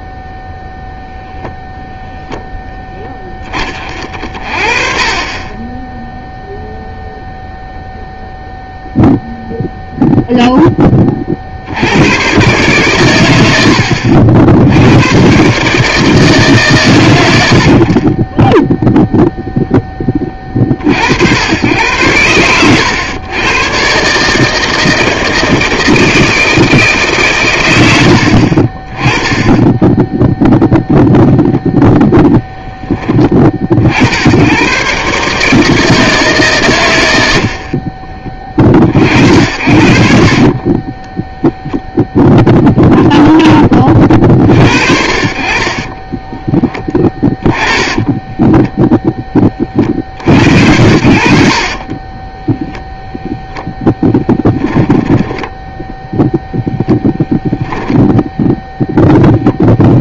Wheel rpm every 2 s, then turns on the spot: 0, 10, 30, 0, 0, 10, 110, 90, 120, 10, 50, 100, 160, 150, 20, 0, 10, 120, 110, 40, 20, 0, 50, 10, 10, 60, 0, 10, 0, 0.
40-42 54-56